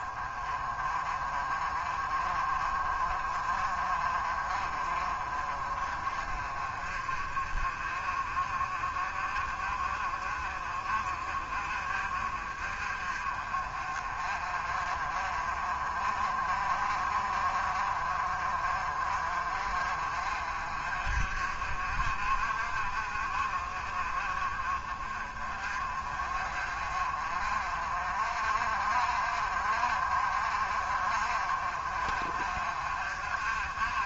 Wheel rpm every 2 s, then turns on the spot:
30, 30, 30, 40, 40, 40, 40, 40, 40, 40, 40, 40, 30, 40, 40, 40, 50.
none